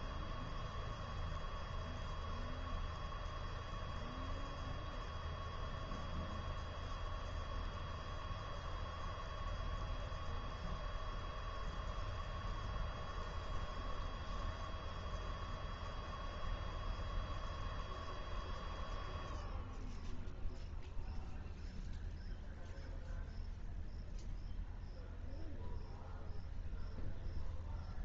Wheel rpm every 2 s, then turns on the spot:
0, 0, 0, 0, 0, 0, 0, 0, 0, 0, 0, 0, 0, 0.
none